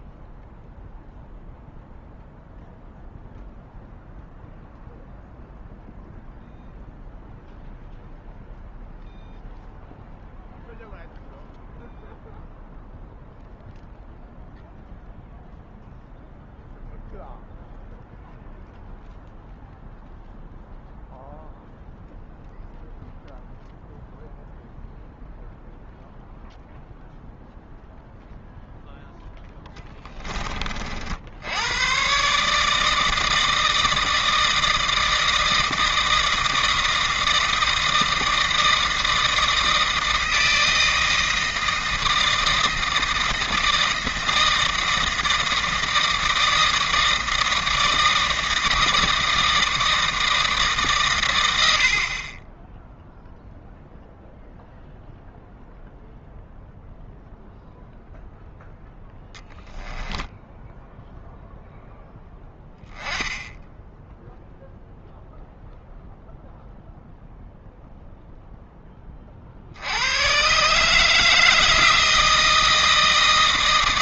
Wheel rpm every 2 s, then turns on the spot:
0, 0, 0, 0, 0, 0, 0, 0, 0, 0, 0, 0, 0, 0, 0, 40, 150, 160, 160, 160, 160, 160, 160, 160, 160, 150, 10, 0, 0, 0, 0, 0, 0, 0, 10, 140, 160.
none